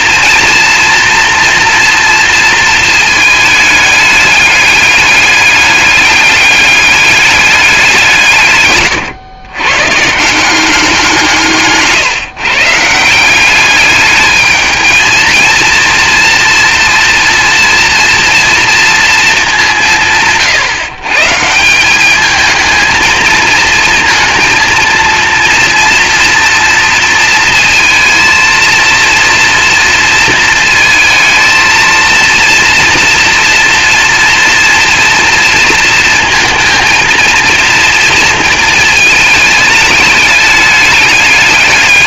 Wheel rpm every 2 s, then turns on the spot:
230, 230, 210, 210, 130, 180, 160, 220, 230, 230, 130, 220, 230, 230, 230, 220, 230, 230, 230, 220, 210.
none